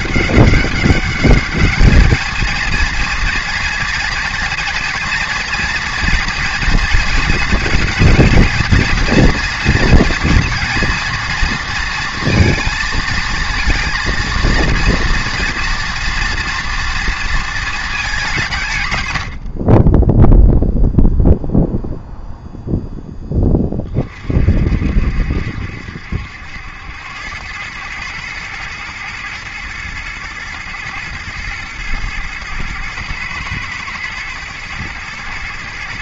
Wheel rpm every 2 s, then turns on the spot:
200, 230, 230, 230, 230, 230, 230, 230, 230, 110, 0, 0, 60, 90, 110, 120, 110, 110.
18-20